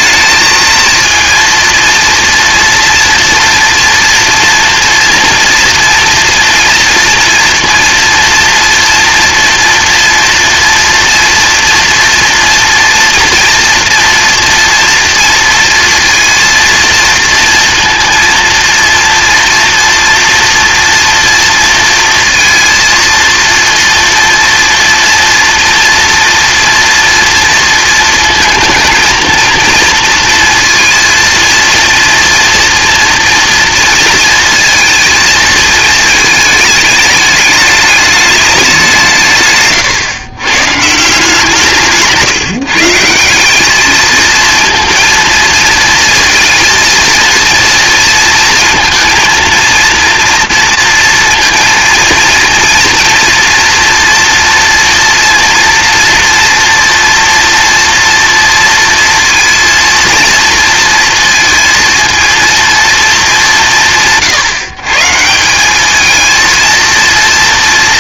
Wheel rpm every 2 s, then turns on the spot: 220, 230, 240, 230, 230, 230, 240, 230, 230, 230, 230, 230, 230, 230, 220, 230, 230, 230, 220, 190, 140, 150, 230, 230, 230, 230, 230, 230, 230, 230, 230, 230, 150, 230.
none